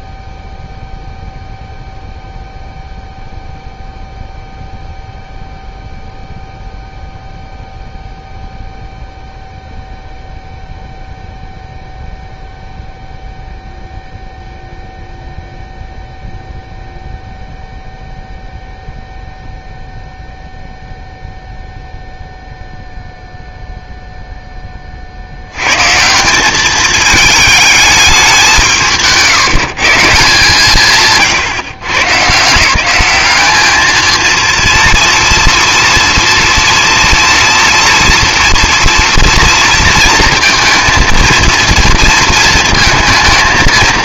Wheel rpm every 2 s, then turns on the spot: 0, 0, 0, 0, 0, 0, 0, 0, 0, 0, 0, 0, 30, 210, 160, 150, 170, 230, 230, 230, 220, 230.
none